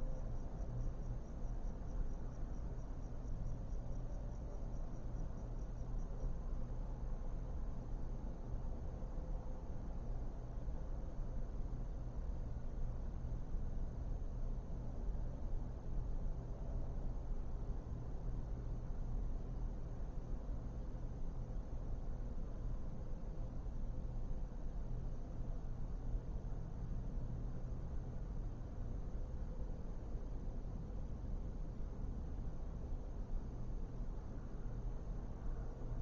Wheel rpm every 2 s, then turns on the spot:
0, 0, 0, 0, 0, 0, 0, 0, 0, 0, 0, 0, 0, 0, 0, 0, 0, 0.
none